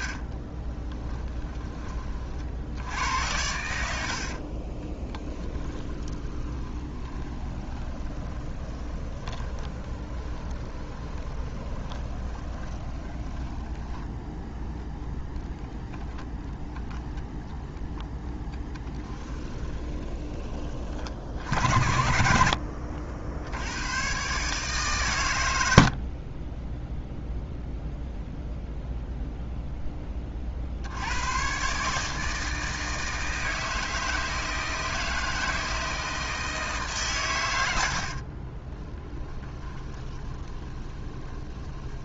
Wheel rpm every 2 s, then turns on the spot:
10, 70, 20, 20, 20, 20, 20, 0, 0, 20, 40, 70, 130, 0, 0, 80, 160, 160, 140, 20, 20.
0-2 4-14 18-20 38-42